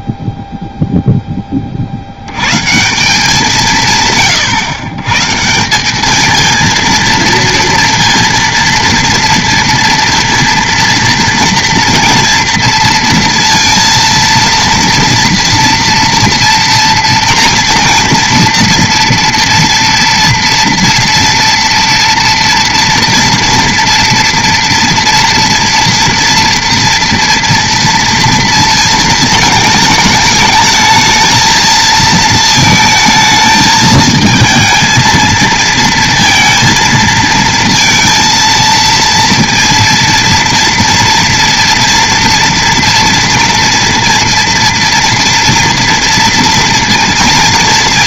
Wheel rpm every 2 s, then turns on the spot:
0, 160, 120, 230, 230, 230, 230, 230, 230, 230, 230, 230, 230, 230, 230, 220, 220, 220, 230, 230, 230, 230, 230, 230.
none